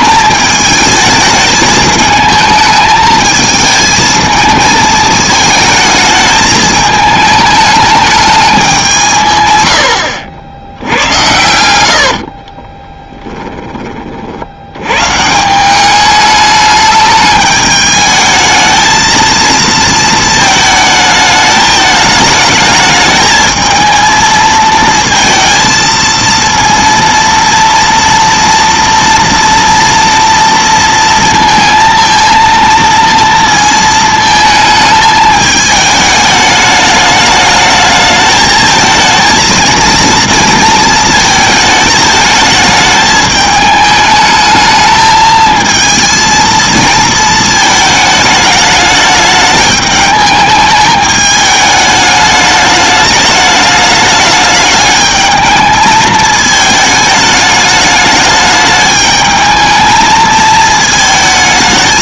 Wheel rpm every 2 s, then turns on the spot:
220, 220, 220, 220, 200, 70, 20, 80, 210, 220, 220, 210, 230, 230, 230, 230, 230, 220, 210, 220, 230, 220, 220, 230, 210, 210, 210, 210, 220, 210, 220.
12-14